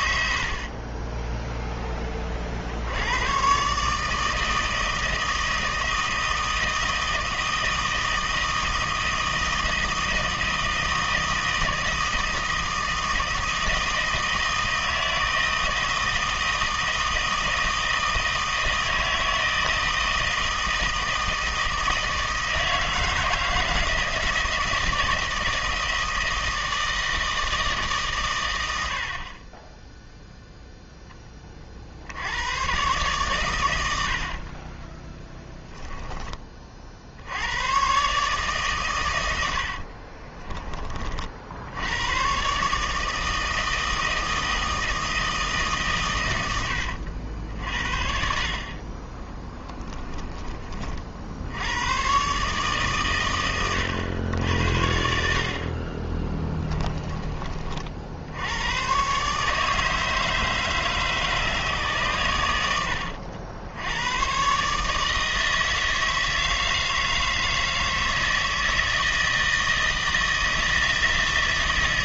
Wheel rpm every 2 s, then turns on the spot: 30, 70, 160, 160, 160, 160, 160, 160, 160, 160, 160, 160, 160, 160, 90, 0, 120, 20, 50, 130, 30, 140, 160, 80, 40, 40, 130, 80, 20, 120, 150, 100, 140, 160, 160, 160.
34-36 46-48 56-58